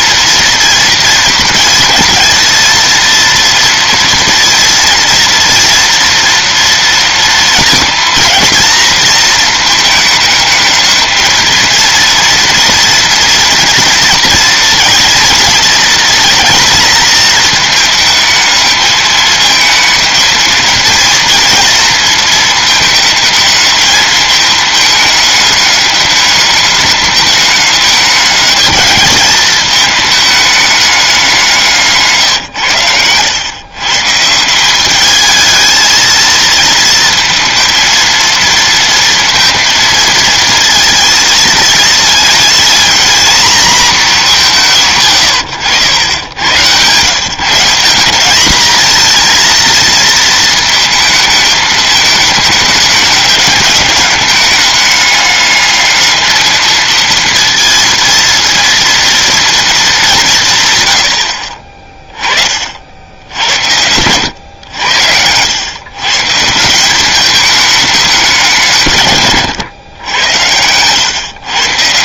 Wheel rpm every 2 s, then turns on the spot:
230, 230, 230, 230, 230, 210, 230, 230, 230, 220, 220, 220, 210, 210, 210, 210, 120, 180, 220, 230, 220, 230, 170, 90, 190, 220, 210, 210, 220, 230, 160, 40, 90, 170, 160, 100.
none